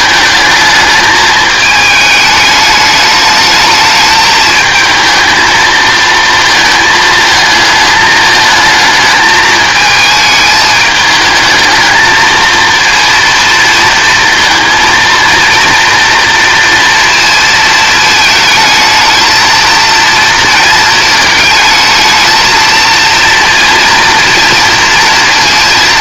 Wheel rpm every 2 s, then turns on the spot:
220, 210, 220, 220, 220, 210, 230, 230, 230, 220, 220, 230, 230.
none